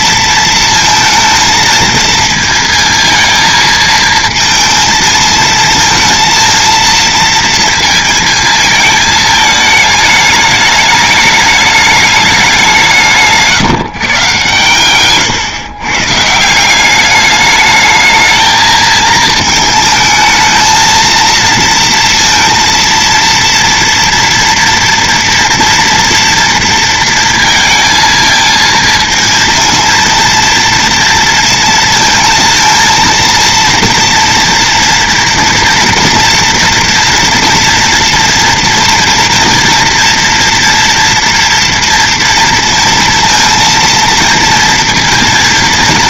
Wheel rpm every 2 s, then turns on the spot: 230, 220, 220, 230, 220, 210, 180, 130, 180, 220, 220, 230, 230, 230, 220, 230, 230, 230, 240, 230, 230, 230, 230.
none